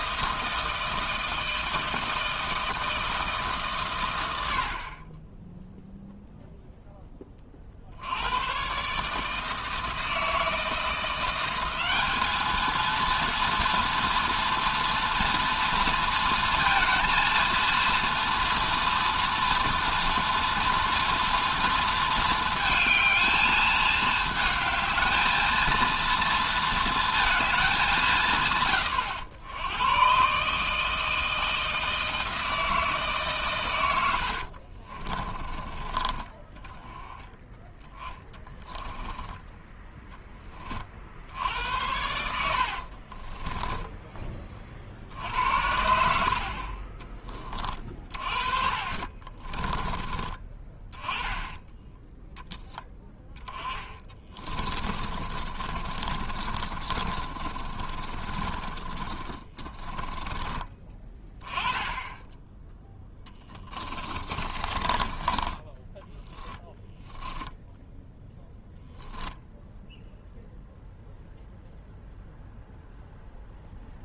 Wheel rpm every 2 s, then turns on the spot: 160, 160, 80, 0, 120, 170, 220, 240, 230, 230, 230, 220, 220, 230, 130, 150, 160, 50, 20, 10, 30, 60, 30, 50, 40, 20, 0, 20, 30, 30, 20, 20, 30, 0, 0, 0, 0.
34-36 38-40 42-44 48-50 54-60 64-66